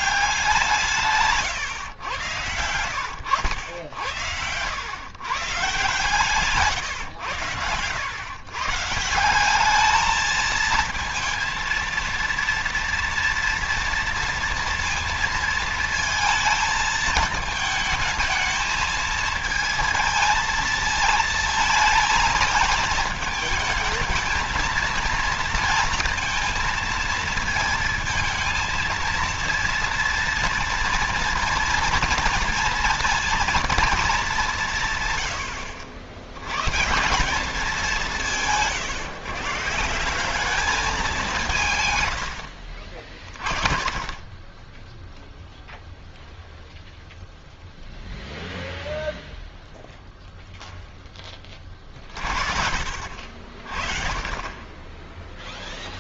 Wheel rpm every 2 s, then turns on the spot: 160, 90, 110, 130, 140, 230, 230, 230, 220, 220, 230, 220, 230, 230, 230, 230, 230, 150, 160, 140, 200, 40, 10, 0, 0, 10, 50, 10.
none